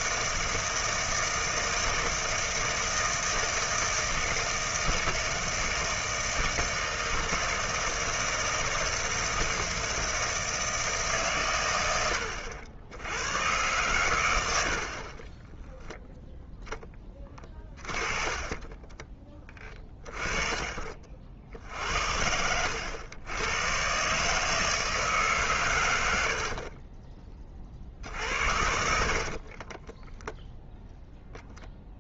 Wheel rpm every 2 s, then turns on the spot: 160, 160, 160, 160, 160, 160, 80, 80, 0, 20, 30, 80, 160, 40, 70, 0.
18-22 26-30